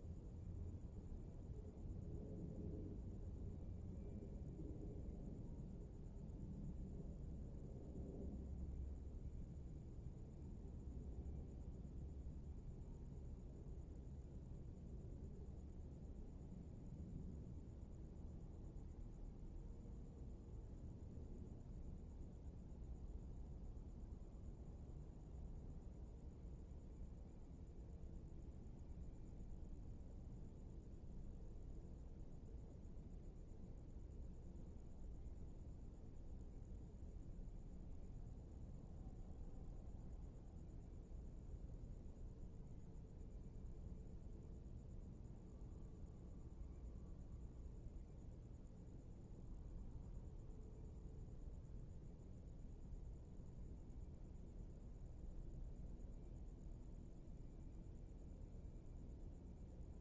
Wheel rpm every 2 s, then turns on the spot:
0, 0, 0, 0, 0, 0, 0, 0, 0, 0, 0, 0, 0, 0, 0, 0, 0, 0, 0, 0, 0, 0, 0, 0, 0, 0, 0, 0, 0, 0.
none